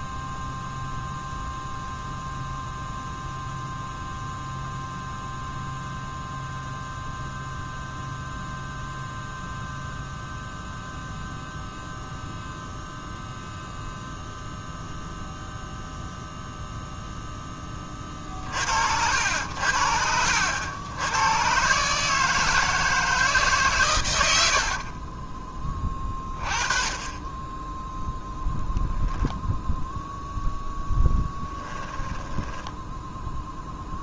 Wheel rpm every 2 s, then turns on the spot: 0, 0, 0, 0, 0, 0, 0, 0, 0, 60, 100, 160, 50, 20, 0, 0, 10.
24-26 32-34